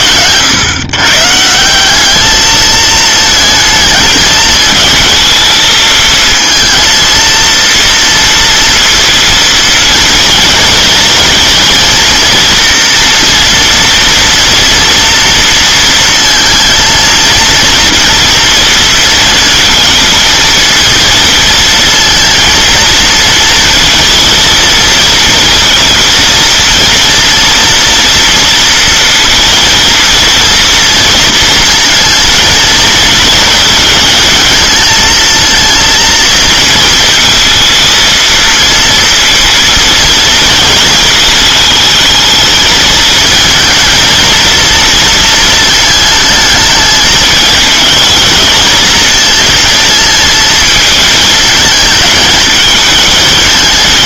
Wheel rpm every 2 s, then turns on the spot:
110, 220, 220, 220, 230, 230, 240, 230, 230, 230, 230, 230, 230, 230, 230, 230, 220, 220, 230, 230, 220, 220, 230, 220, 220, 220, 210.
none